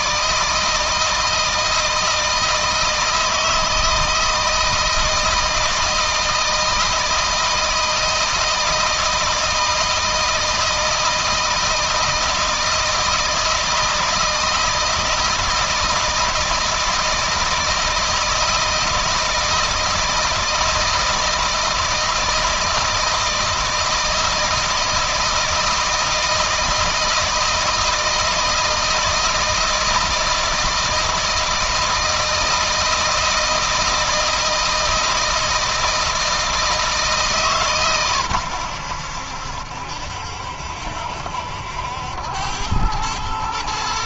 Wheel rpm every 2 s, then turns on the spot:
160, 160, 160, 160, 170, 160, 160, 160, 160, 160, 160, 160, 160, 160, 160, 160, 160, 160, 150, 90, 70, 100.
none